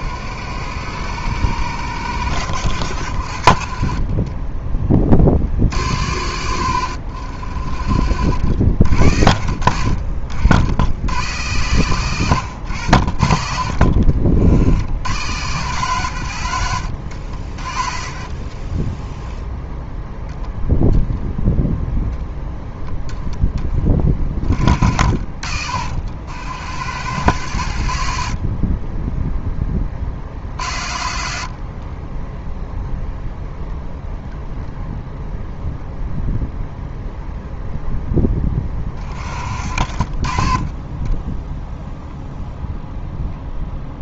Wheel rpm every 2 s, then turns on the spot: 90, 90, 20, 90, 70, 80, 100, 70, 100, 30, 0, 0, 50, 80, 50, 70, 10, 0, 0, 20, 30, 0.
28-30 32-34